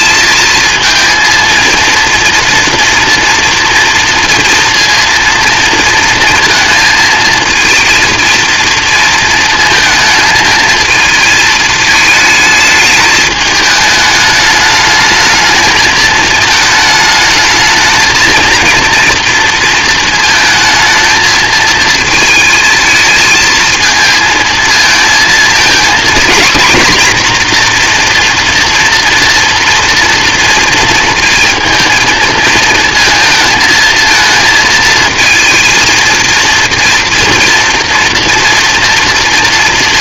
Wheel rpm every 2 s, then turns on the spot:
220, 230, 230, 220, 230, 220, 210, 210, 220, 230, 220, 220, 220, 250, 240, 230, 230, 230, 230, 230.
none